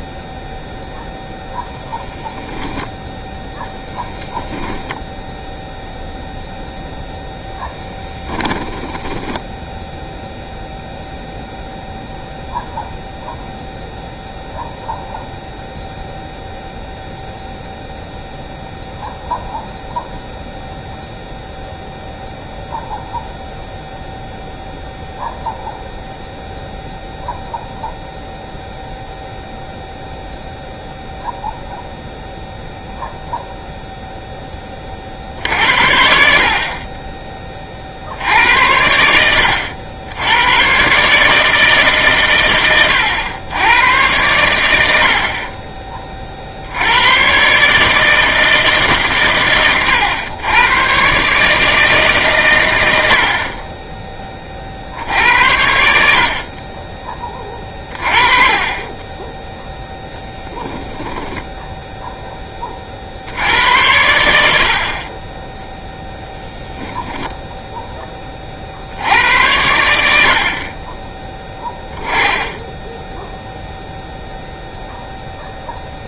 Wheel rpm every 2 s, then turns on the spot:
0, 10, 0, 0, 10, 0, 0, 0, 0, 0, 0, 0, 0, 0, 0, 0, 0, 40, 20, 80, 120, 110, 80, 90, 140, 120, 90, 60, 30, 20, 10, 20, 70, 0, 80, 30, 10, 0.
2-4 8-10 60-62